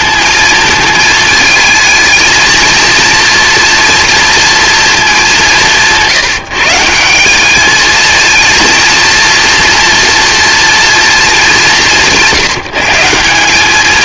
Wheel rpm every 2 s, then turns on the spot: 220, 230, 220, 160, 230, 230, 170.
none